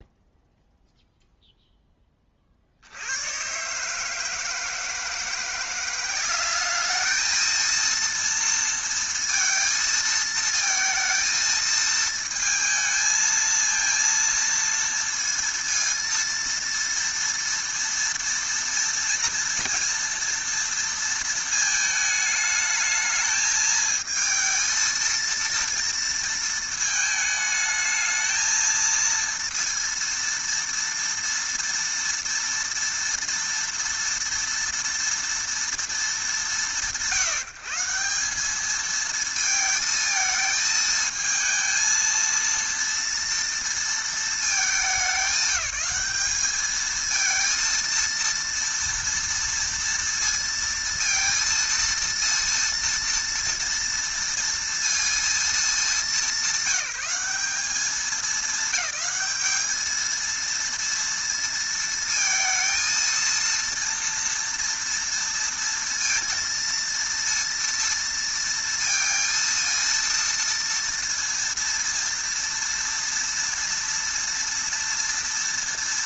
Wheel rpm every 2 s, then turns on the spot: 0, 60, 160, 200, 230, 220, 220, 230, 230, 230, 230, 220, 230, 220, 220, 230, 230, 240, 180, 200, 220, 230, 210, 210, 230, 230, 230, 230, 190, 210, 230, 230, 230, 230, 230, 230, 230, 230.
none